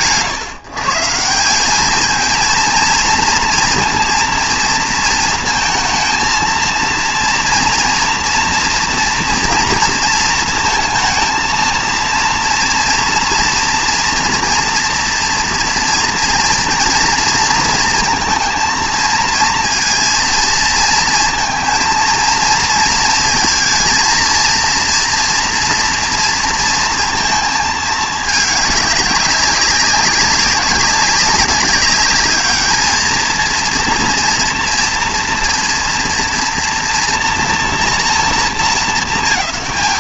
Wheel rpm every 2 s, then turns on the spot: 150, 230, 230, 230, 240, 230, 230, 240, 230, 230, 230, 230, 230, 230, 200, 200, 210, 230, 230, 210.
none